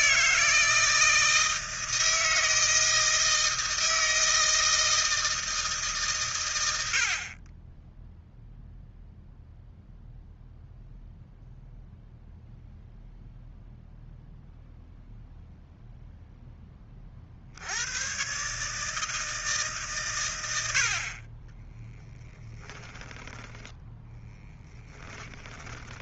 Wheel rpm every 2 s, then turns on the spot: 160, 160, 160, 100, 0, 0, 0, 0, 10, 150, 60, 10, 10.
22-26